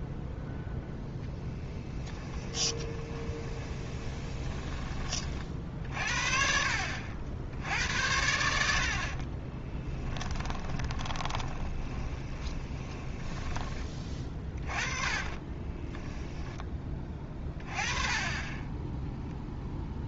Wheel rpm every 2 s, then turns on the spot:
0, 20, 20, 60, 50, 20, 20, 20, 10, 10.
2-4 8-16